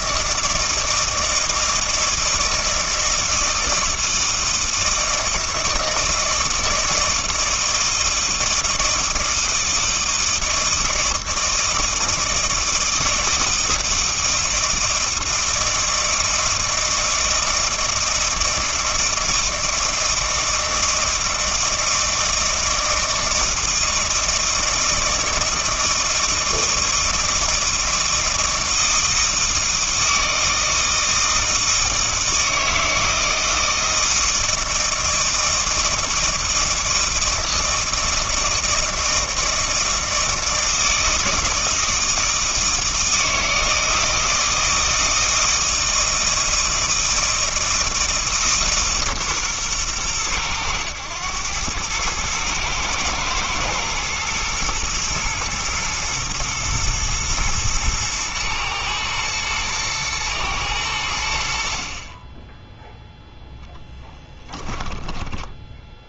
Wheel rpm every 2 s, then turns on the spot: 160, 160, 160, 160, 160, 160, 160, 160, 160, 160, 160, 160, 160, 160, 160, 160, 160, 160, 160, 160, 160, 160, 160, 160, 150, 100, 110, 110, 120, 110, 100, 10, 10.
64-66